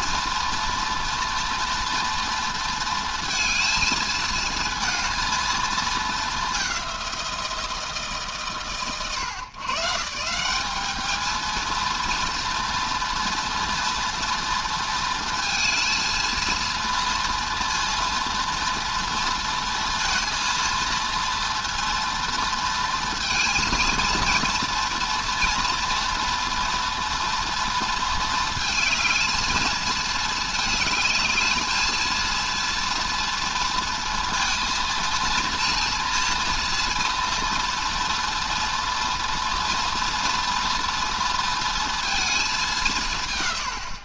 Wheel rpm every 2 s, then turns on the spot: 240, 230, 230, 200, 130, 210, 230, 230, 230, 230, 230, 230, 230, 240, 220, 220, 230, 230, 230, 240, 230, 190.
none